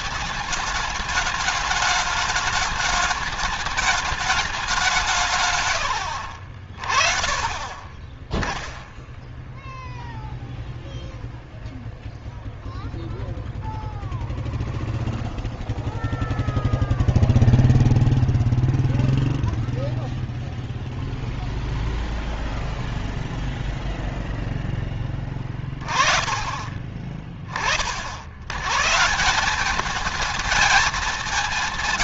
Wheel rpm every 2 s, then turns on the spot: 190, 210, 200, 50, 10, 0, 0, 0, 0, 0, 0, 0, 0, 30, 120, 210.
none